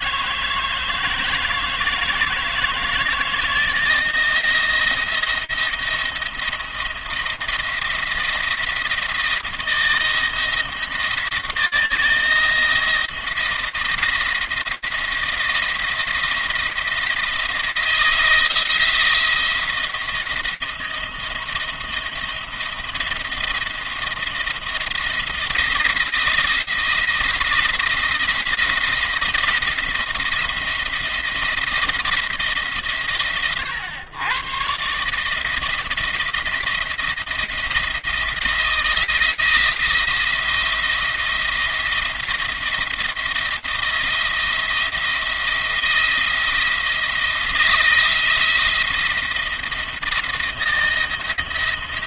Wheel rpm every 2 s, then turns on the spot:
160, 160, 170, 170, 170, 170, 170, 170, 170, 170, 170, 170, 170, 170, 170, 170, 140, 130, 170, 170, 170, 170, 170, 170, 170, 160.
none